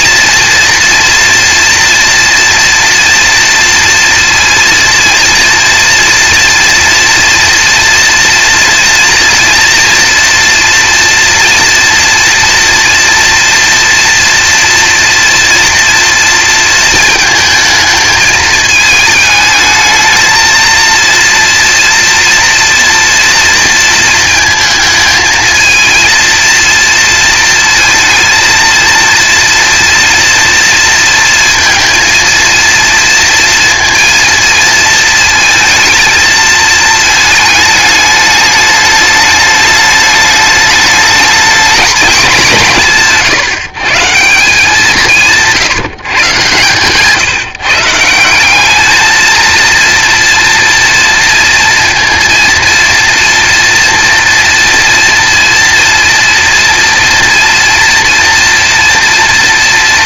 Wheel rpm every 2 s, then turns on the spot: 230, 230, 230, 230, 240, 230, 240, 230, 230, 220, 220, 230, 220, 230, 230, 230, 230, 230, 220, 210, 210, 180, 180, 130, 200, 230, 230, 230, 230, 230.
none